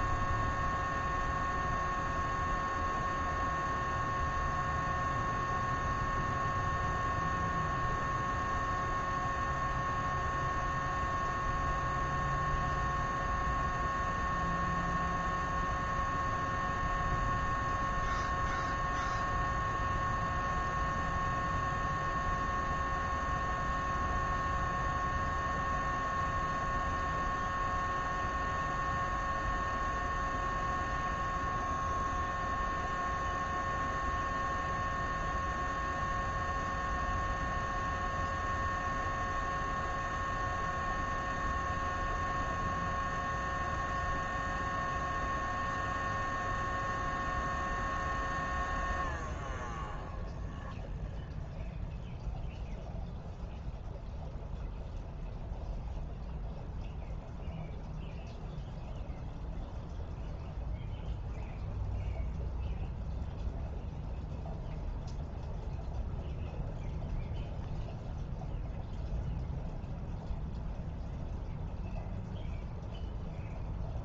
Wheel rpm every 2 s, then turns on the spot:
0, 0, 0, 0, 0, 0, 0, 0, 0, 0, 0, 0, 0, 0, 0, 0, 0, 0, 0, 0, 0, 0, 0, 0, 0, 0, 0, 0, 0, 0, 0, 0, 0, 0, 0, 0, 0.
none